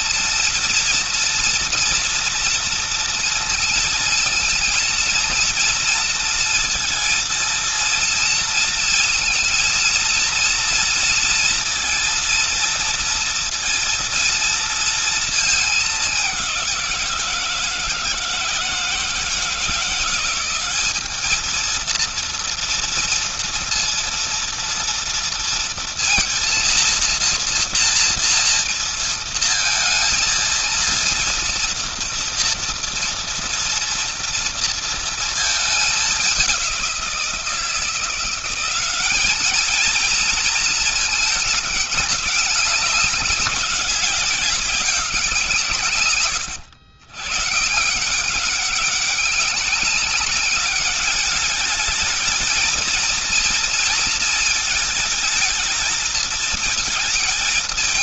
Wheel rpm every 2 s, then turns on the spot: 240, 230, 230, 230, 230, 230, 230, 230, 180, 160, 190, 230, 230, 230, 230, 230, 230, 230, 190, 190, 220, 200, 190, 110, 190, 200, 230, 220, 230.
none